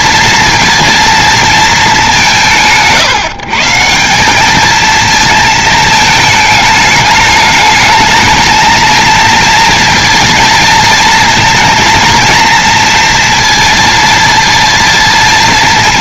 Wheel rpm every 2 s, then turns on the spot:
230, 150, 210, 210, 220, 230, 230, 230.
none